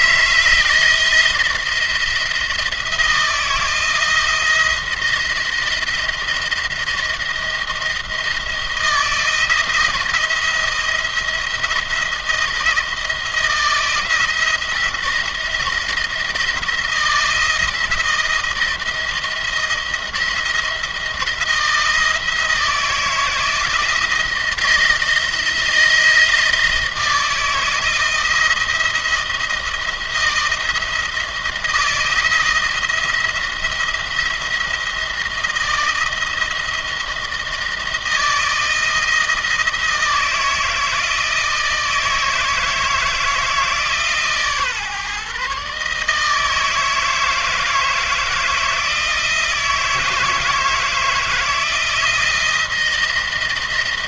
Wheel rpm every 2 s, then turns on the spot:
160, 160, 170, 170, 170, 170, 170, 170, 160, 170, 160, 160, 160, 160, 170, 170, 170, 170, 160, 170, 160, 160, 140, 160, 160, 160, 170.
none